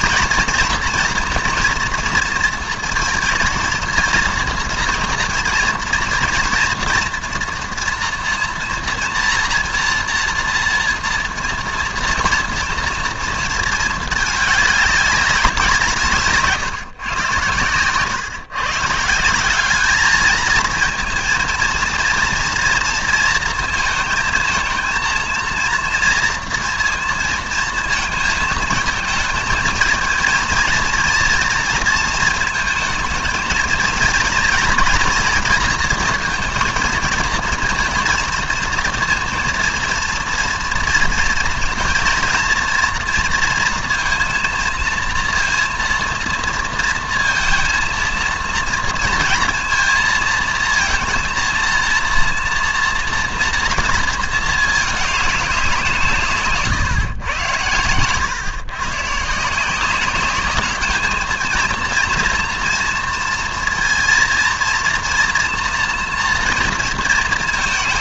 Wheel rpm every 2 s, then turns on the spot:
230, 230, 240, 230, 230, 230, 230, 210, 150, 140, 220, 230, 230, 230, 220, 230, 220, 230, 230, 230, 230, 230, 230, 230, 230, 230, 230, 220, 140, 130, 210, 230, 230, 230.
none